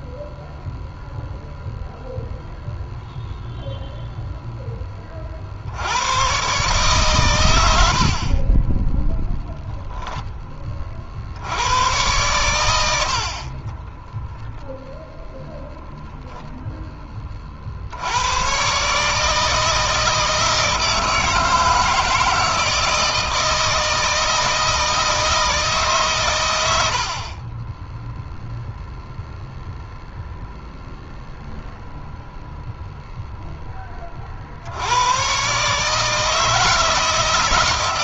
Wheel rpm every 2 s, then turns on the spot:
0, 0, 20, 120, 10, 40, 90, 0, 10, 140, 160, 160, 160, 70, 0, 0, 0, 90, 160.
8-10 12-14